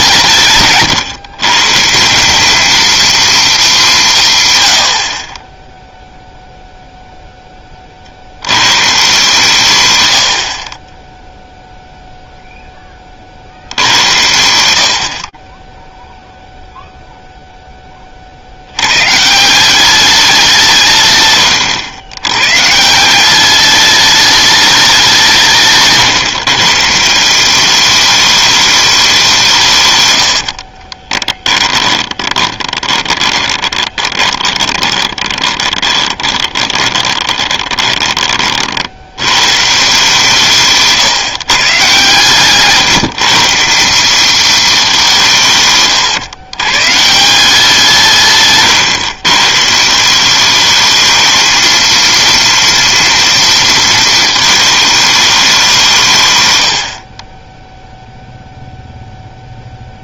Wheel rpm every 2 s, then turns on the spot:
140, 220, 100, 0, 140, 30, 10, 60, 0, 120, 130, 180, 180, 170, 190, 20, 20, 20, 20, 80, 150, 150, 180, 150, 130, 220, 230, 210, 40, 0.
30-38